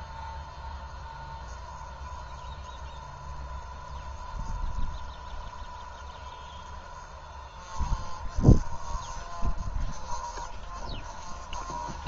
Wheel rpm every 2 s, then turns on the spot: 0, 0, 0, 0, 0, 0.
none